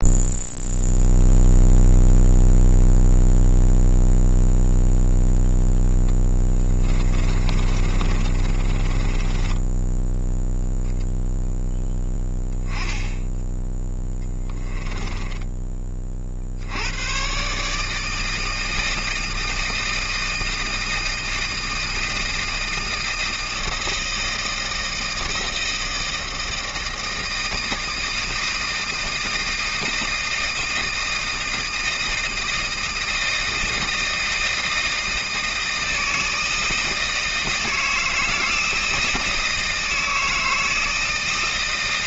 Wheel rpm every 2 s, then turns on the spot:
0, 0, 0, 20, 30, 10, 10, 10, 80, 160, 160, 160, 160, 160, 160, 160, 160, 160, 160, 160, 160.
6-10 14-16